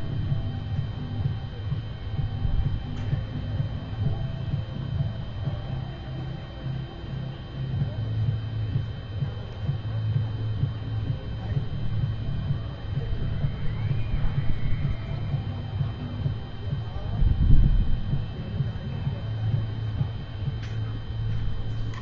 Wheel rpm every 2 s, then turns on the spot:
0, 0, 0, 0, 0, 0, 0, 0, 0, 0, 0.
none